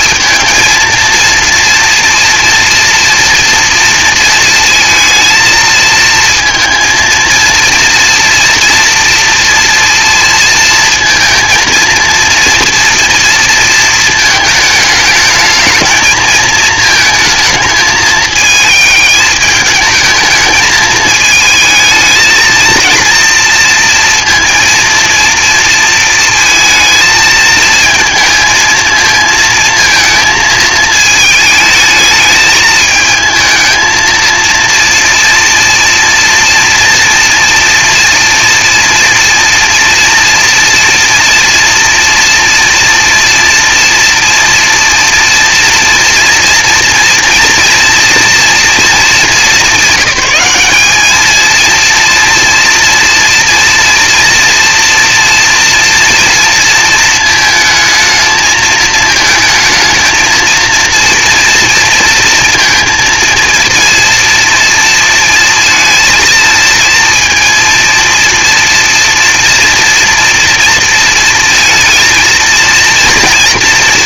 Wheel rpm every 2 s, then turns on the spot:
220, 240, 230, 230, 230, 230, 230, 220, 220, 220, 210, 230, 230, 220, 220, 220, 220, 230, 230, 230, 230, 230, 230, 230, 230, 200, 230, 240, 230, 220, 230, 230, 230, 230, 230, 230, 230.
none